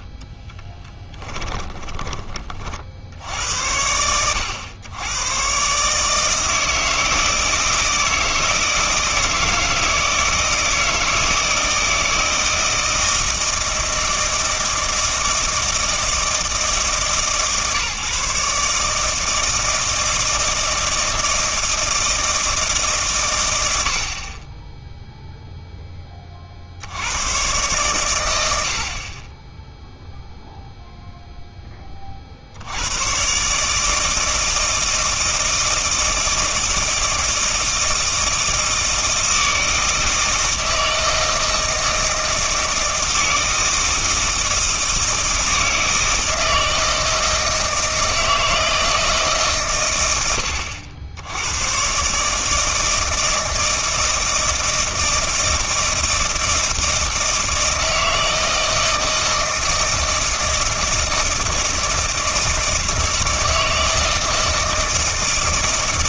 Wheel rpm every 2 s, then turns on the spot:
10, 50, 100, 160, 160, 160, 160, 160, 160, 150, 160, 150, 10, 70, 60, 0, 90, 160, 160, 160, 160, 160, 160, 160, 160, 90, 160, 160, 160, 160, 160, 160, 160.
0-2